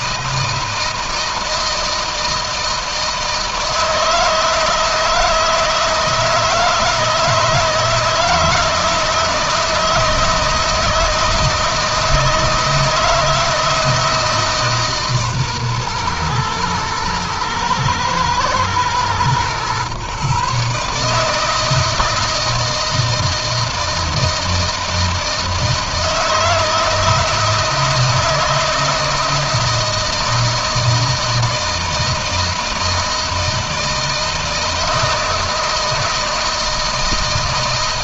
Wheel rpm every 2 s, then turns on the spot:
160, 160, 160, 160, 160, 160, 160, 150, 120, 120, 150, 160, 160, 160, 160, 160, 160, 160, 160.
none